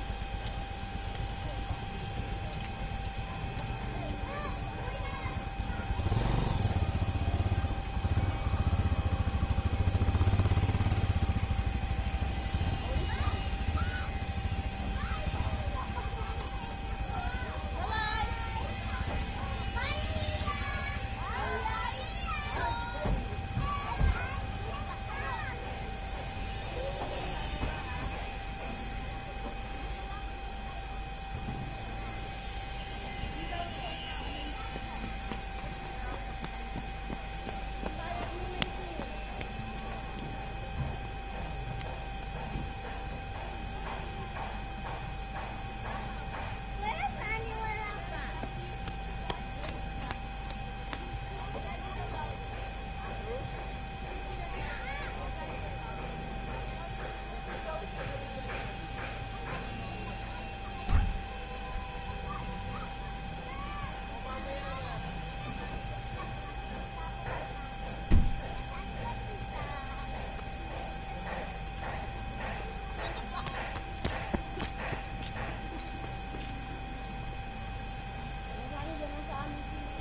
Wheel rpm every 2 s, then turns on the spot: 0, 0, 0, 0, 0, 0, 0, 0, 0, 0, 0, 0, 0, 0, 0, 0, 0, 0, 0, 0, 0, 0, 0, 0, 0, 0, 0, 0, 0, 0, 0, 0, 0, 0, 0, 0, 0, 0, 0, 0.
none